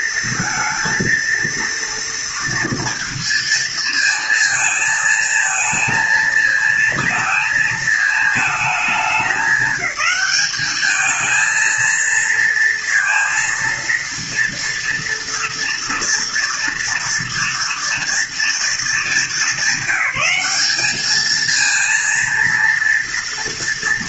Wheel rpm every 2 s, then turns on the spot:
230, 230, 220, 230, 210, 210, 230, 230, 230, 220, 210, 230.
none